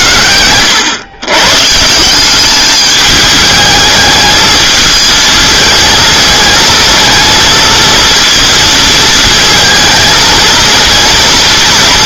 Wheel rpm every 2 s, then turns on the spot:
110, 210, 220, 220, 230, 230.
none